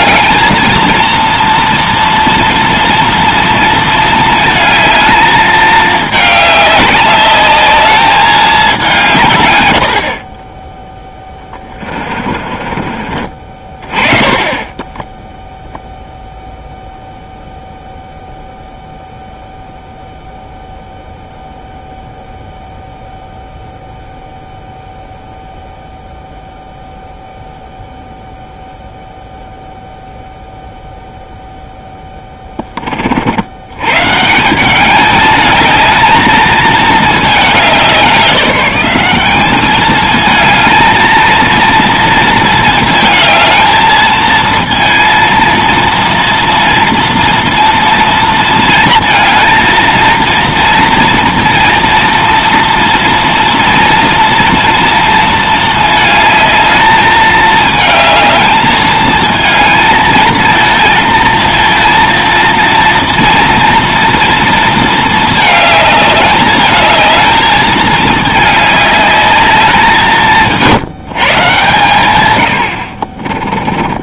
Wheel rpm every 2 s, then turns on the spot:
230, 240, 220, 200, 190, 10, 40, 10, 0, 0, 0, 0, 0, 0, 0, 0, 20, 190, 220, 190, 220, 230, 230, 240, 230, 230, 230, 230, 210, 220, 220, 230, 230, 210, 210, 170, 70.
12-14